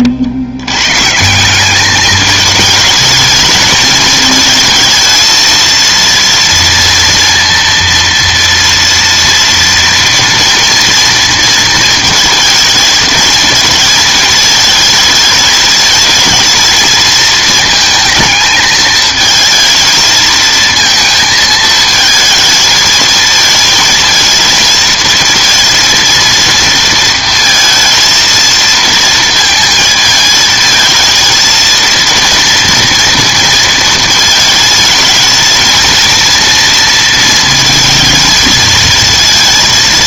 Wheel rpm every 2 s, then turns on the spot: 110, 220, 220, 230, 230, 230, 230, 220, 220, 220, 230, 220, 230, 230, 220, 220, 230, 220, 230, 220.
none